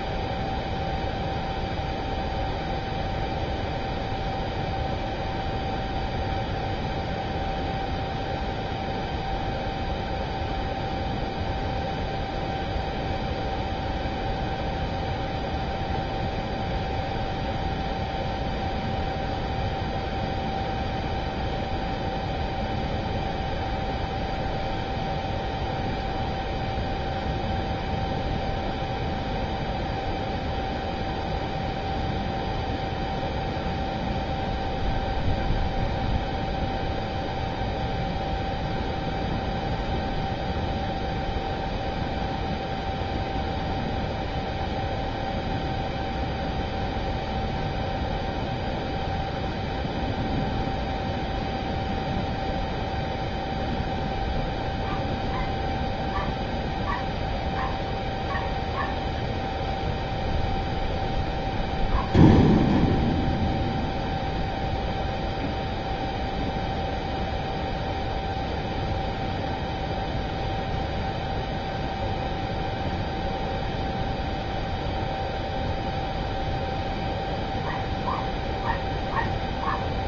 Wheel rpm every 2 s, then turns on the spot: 0, 0, 0, 0, 0, 0, 0, 0, 0, 0, 0, 0, 0, 0, 0, 0, 0, 0, 0, 0, 0, 0, 0, 0, 0, 0, 0, 0, 0, 0, 0, 0, 0, 0, 0, 0, 0, 0, 0, 0.
none